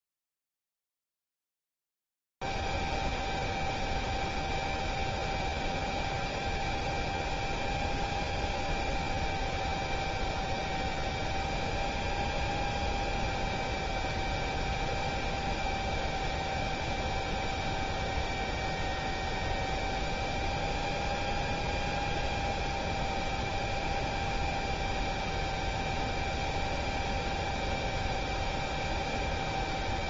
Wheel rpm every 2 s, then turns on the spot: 0, 0, 0, 0, 0, 0, 0, 0, 0, 0, 0, 0, 0, 0, 0.
none